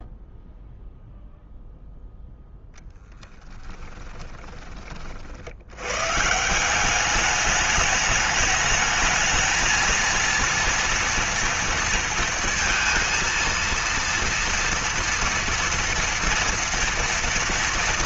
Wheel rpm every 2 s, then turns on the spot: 0, 10, 30, 170, 220, 230, 230, 230, 230.
none